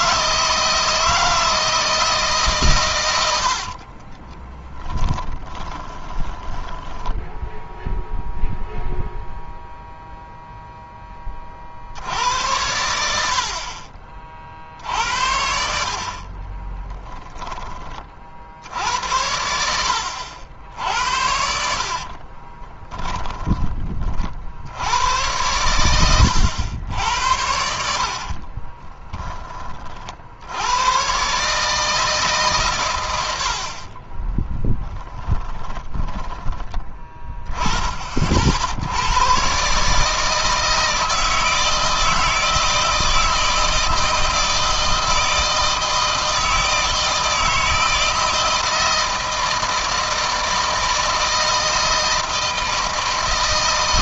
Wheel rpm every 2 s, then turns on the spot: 160, 120, 20, 10, 0, 10, 80, 60, 20, 80, 80, 20, 90, 80, 20, 110, 110, 10, 10, 90, 160, 160, 160, 160, 160, 160, 160.
4-8 16-18 22-24 28-30 34-36